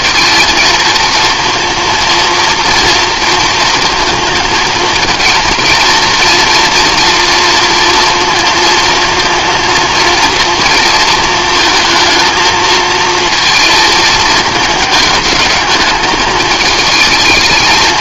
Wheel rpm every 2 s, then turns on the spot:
230, 230, 220, 230, 230, 230, 230, 220, 220.
none